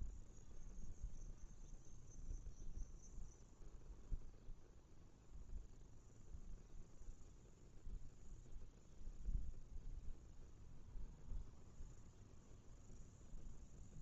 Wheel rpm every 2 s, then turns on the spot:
0, 0, 0, 0, 0, 0, 0.
none